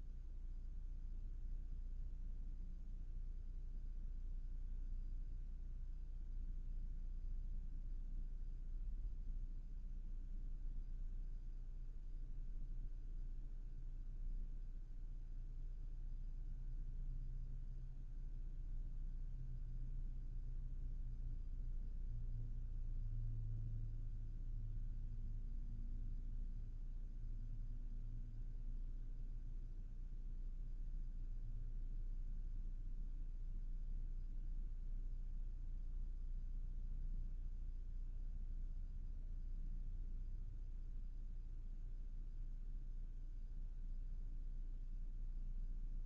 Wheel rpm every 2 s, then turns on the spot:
0, 0, 0, 0, 0, 0, 0, 0, 0, 0, 0, 0, 0, 0, 0, 0, 0, 0, 0, 0, 0, 0, 0.
none